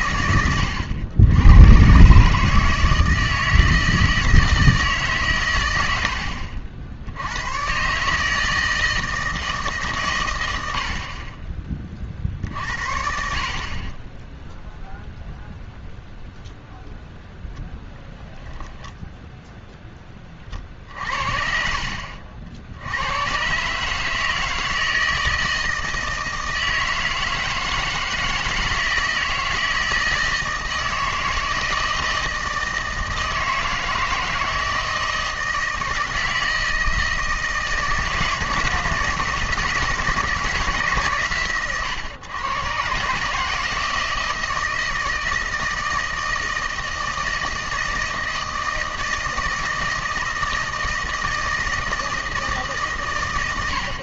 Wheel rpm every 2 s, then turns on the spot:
100, 160, 160, 70, 160, 80, 60, 0, 0, 10, 40, 70, 160, 160, 160, 160, 160, 160, 160, 160, 160, 130, 160, 160, 160, 160, 150.
none